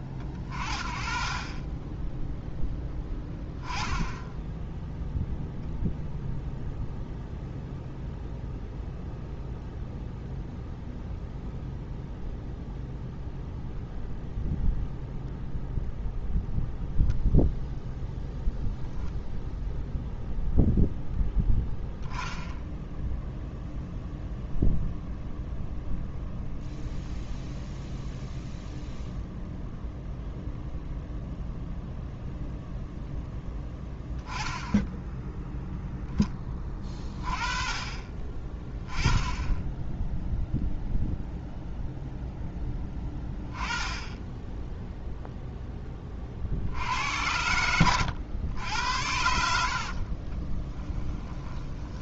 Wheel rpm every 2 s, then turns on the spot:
30, 0, 0, 0, 0, 0, 0, 0, 0, 10, 0, 0, 0, 0, 0, 0, 0, 10, 20, 20, 0, 10, 0, 70, 90, 20.
50-52